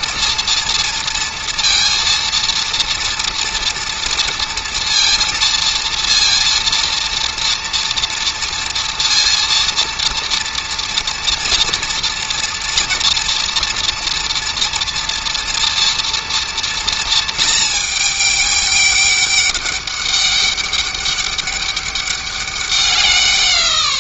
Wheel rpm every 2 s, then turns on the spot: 230, 230, 230, 230, 230, 240, 240, 230, 230, 200, 200, 190.
none